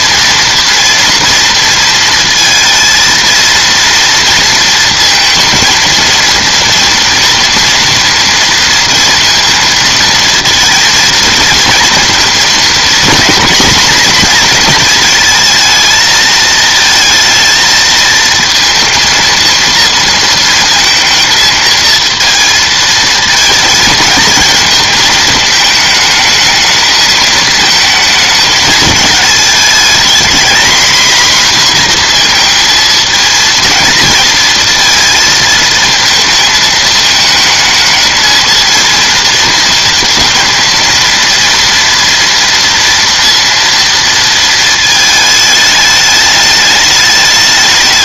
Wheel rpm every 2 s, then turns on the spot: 230, 230, 220, 230, 230, 220, 240, 220, 220, 230, 220, 220, 220, 220, 210, 240, 220, 220, 220, 220, 230, 230, 220, 210.
none